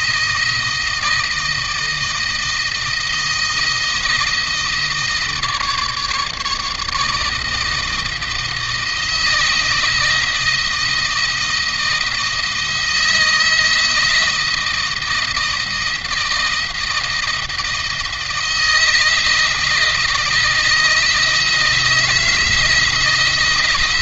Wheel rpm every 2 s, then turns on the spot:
160, 160, 160, 160, 160, 160, 160, 160, 170, 160, 160, 160.
none